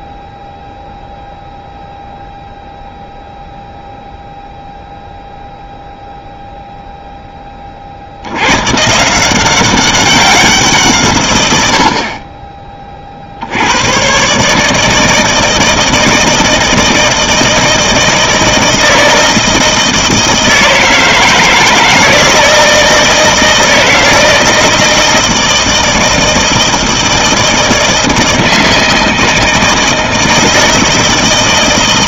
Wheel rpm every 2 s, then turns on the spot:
0, 0, 0, 0, 110, 170, 30, 150, 160, 160, 160, 160, 160, 160, 160, 160.
none